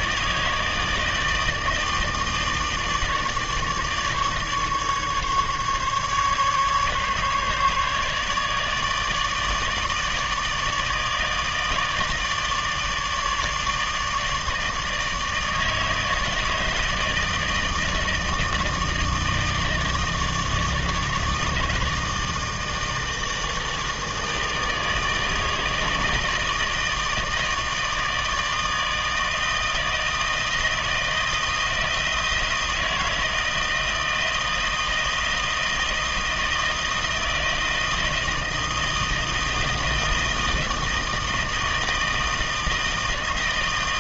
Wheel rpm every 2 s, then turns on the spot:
160, 150, 150, 140, 150, 160, 150, 160, 160, 160, 160, 160, 160, 160, 160, 160, 160, 160, 160, 160, 160, 160.
none